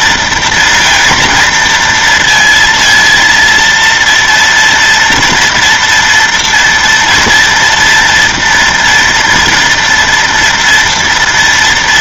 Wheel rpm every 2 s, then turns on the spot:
230, 230, 240, 230, 230, 230.
none